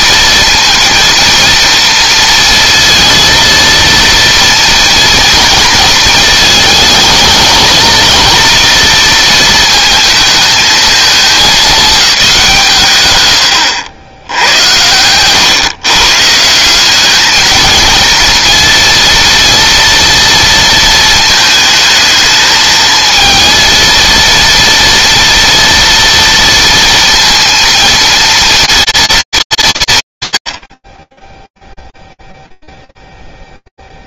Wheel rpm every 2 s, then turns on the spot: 230, 230, 230, 220, 230, 220, 140, 100, 190, 230, 230, 220, 230, 230, 230, 50, 0.
none